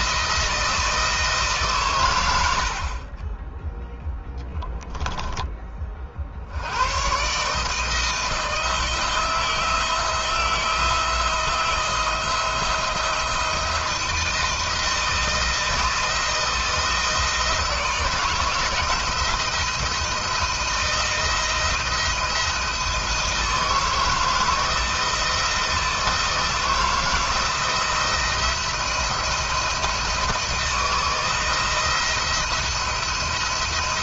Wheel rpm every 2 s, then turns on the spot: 160, 60, 10, 90, 160, 170, 170, 170, 160, 160, 160, 160, 160, 160, 170, 160, 170.
none